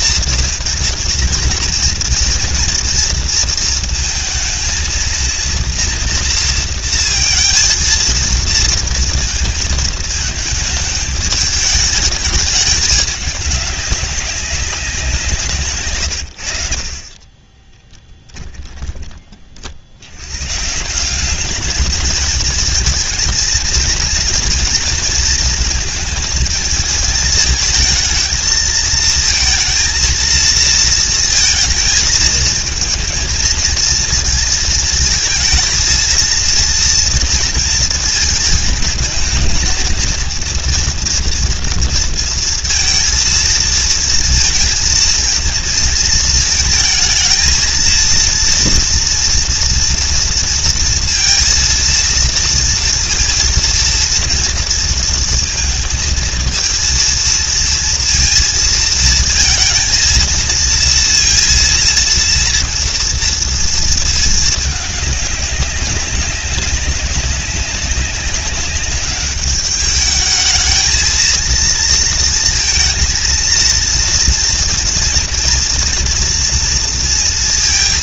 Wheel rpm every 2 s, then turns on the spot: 230, 230, 220, 230, 230, 210, 210, 180, 70, 20, 150, 220, 230, 220, 220, 230, 220, 220, 230, 220, 230, 230, 230, 220, 230, 230, 230, 230, 230, 230, 230, 230, 210, 190, 200, 220, 230, 230, 230.
18-20